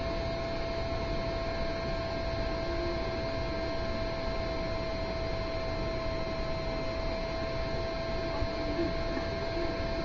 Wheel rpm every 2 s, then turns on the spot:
0, 0, 0, 0, 0.
none